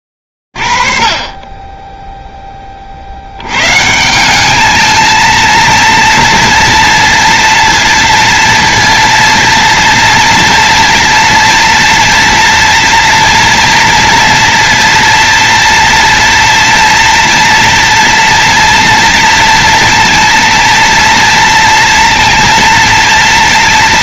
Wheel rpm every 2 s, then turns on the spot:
30, 0, 180, 230, 230, 230, 230, 230, 230, 230, 230, 230.
none